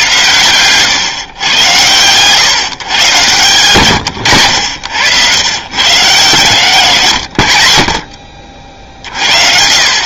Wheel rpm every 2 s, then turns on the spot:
120, 130, 90, 130, 50.
none